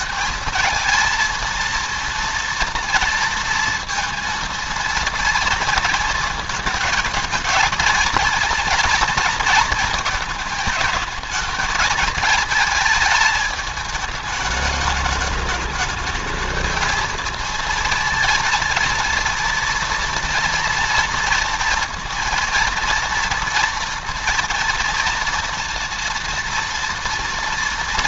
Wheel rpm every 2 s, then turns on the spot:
220, 230, 230, 220, 230, 220, 220, 210, 220, 230, 230, 230, 230, 230.
none